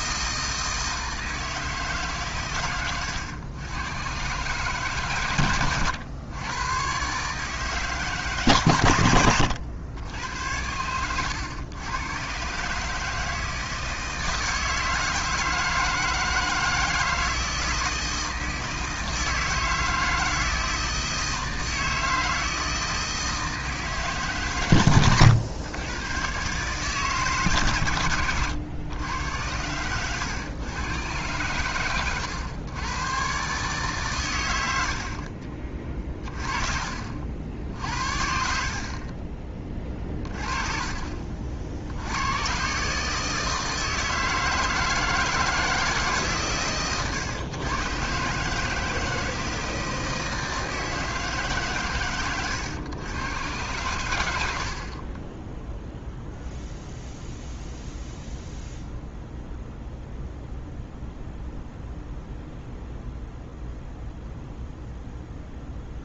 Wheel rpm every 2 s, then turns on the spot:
160, 110, 140, 130, 110, 100, 150, 160, 160, 160, 160, 160, 130, 140, 110, 120, 110, 70, 50, 40, 30, 140, 160, 120, 160, 160, 120, 40, 0, 0, 0, 0, 0.
24-26 38-40